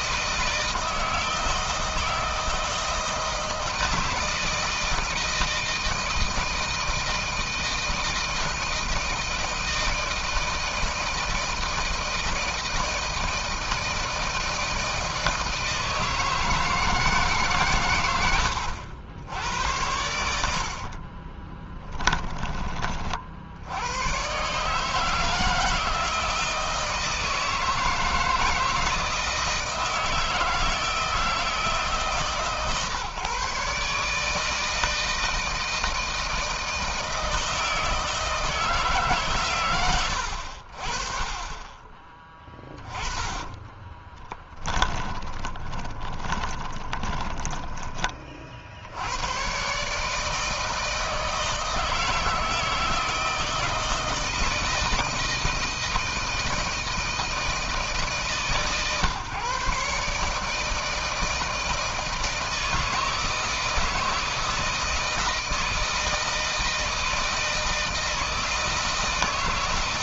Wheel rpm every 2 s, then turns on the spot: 160, 160, 160, 160, 160, 160, 160, 160, 150, 90, 40, 60, 160, 160, 160, 160, 140, 160, 160, 140, 40, 30, 20, 20, 90, 160, 160, 160, 160, 140, 160, 160, 160, 160, 160.
20-22 42-48